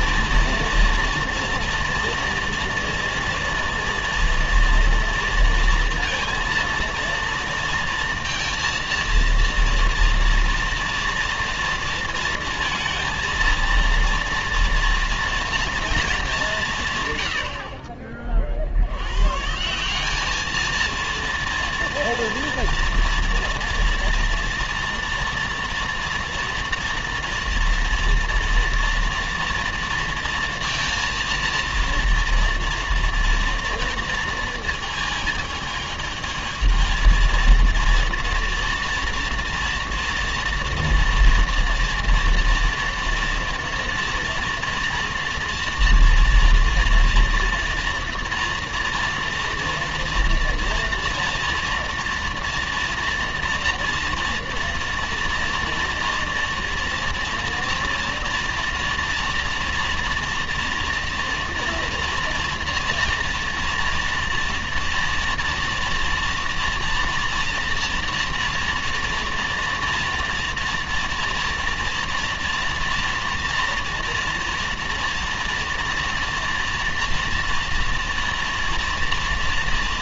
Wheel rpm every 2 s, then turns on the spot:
230, 230, 230, 230, 230, 230, 230, 230, 210, 40, 210, 230, 230, 230, 230, 230, 230, 230, 220, 230, 230, 230, 230, 230, 240, 230, 230, 230, 230, 230, 240, 230, 230, 230, 240, 240, 230, 230, 230, 230.
none